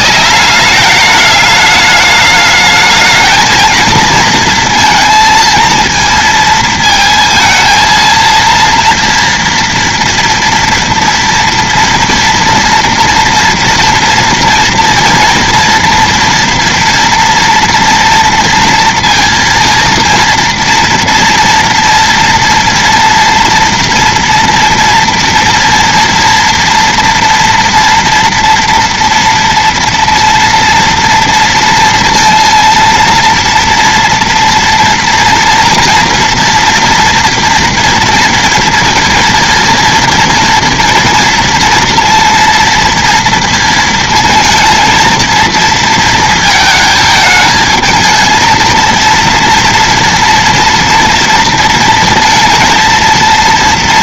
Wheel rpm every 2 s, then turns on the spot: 210, 210, 230, 230, 230, 240, 230, 230, 230, 230, 230, 230, 230, 240, 230, 230, 230, 230, 230, 230, 230, 230, 230, 220, 230, 230, 230.
none